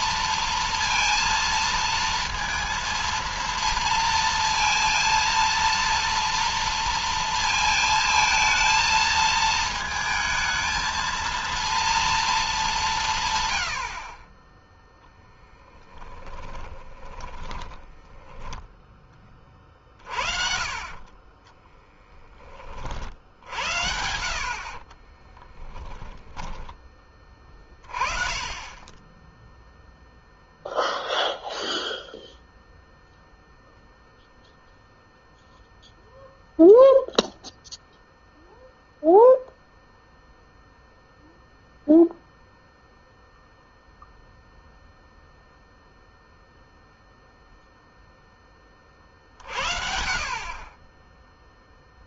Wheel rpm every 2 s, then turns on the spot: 230, 230, 230, 230, 230, 220, 220, 30, 10, 10, 40, 30, 50, 10, 20, 0, 0, 0, 0, 0, 0, 0, 0, 0, 20, 40.
16-22 24-28